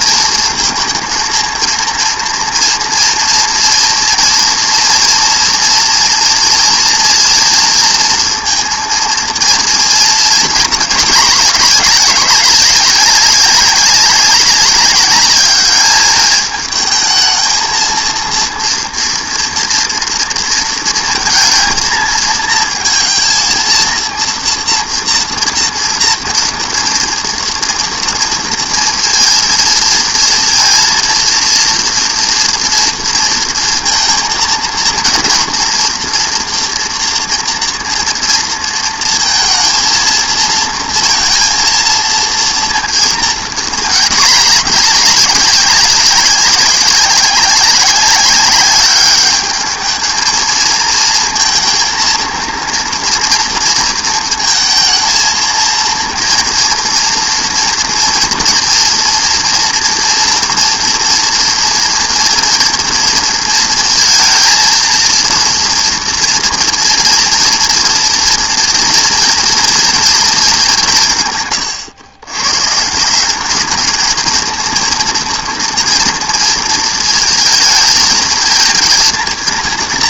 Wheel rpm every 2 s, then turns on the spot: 230, 230, 230, 230, 230, 220, 200, 200, 220, 230, 230, 230, 230, 230, 230, 230, 230, 230, 230, 230, 230, 230, 210, 190, 200, 230, 230, 220, 230, 230, 230, 230, 230, 230, 230, 200, 130, 230, 230, 230.
none